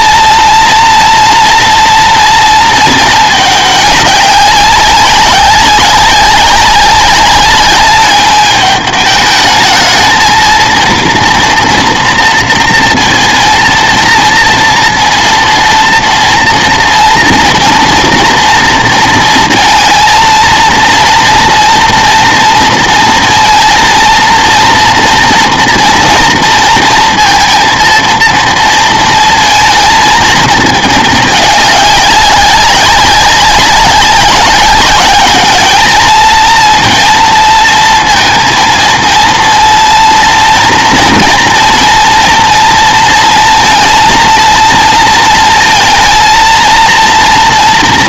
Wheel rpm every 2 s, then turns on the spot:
230, 220, 200, 200, 210, 230, 230, 230, 230, 230, 230, 230, 230, 230, 230, 220, 190, 200, 230, 230, 230, 230, 230, 230.
none